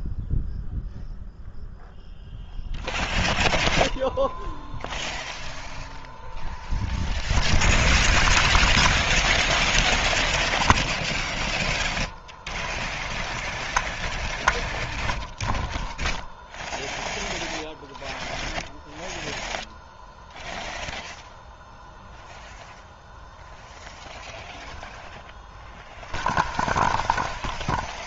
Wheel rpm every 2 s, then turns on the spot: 0, 0, 0, 0, 0, 0, 0, 0, 0, 0, 0, 0, 0, 0.
none